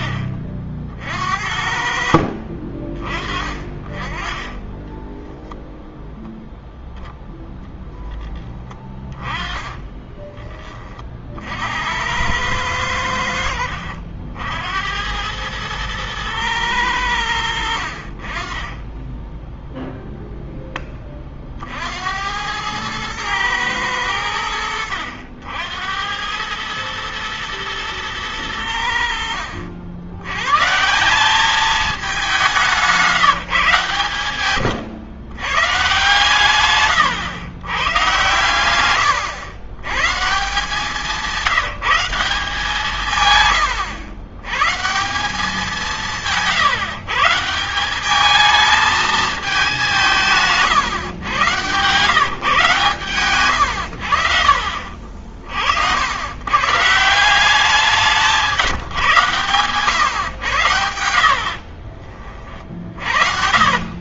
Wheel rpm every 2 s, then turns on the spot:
60, 50, 30, 10, 10, 20, 100, 70, 110, 30, 0, 80, 100, 100, 100, 120, 200, 120, 130, 110, 160, 180, 120, 180, 210, 150, 140, 70, 110, 170, 120, 40.
36-38 62-64